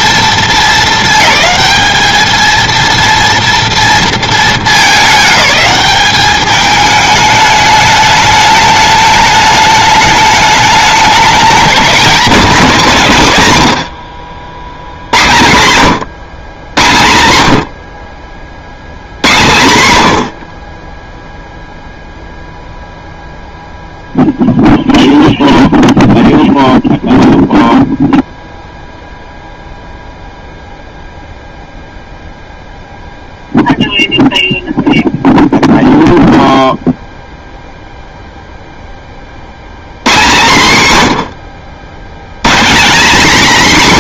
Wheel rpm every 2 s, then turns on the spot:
220, 230, 220, 210, 210, 210, 240, 70, 120, 70, 40, 0, 0, 0, 0, 0, 0, 0, 0, 0, 150, 180.
none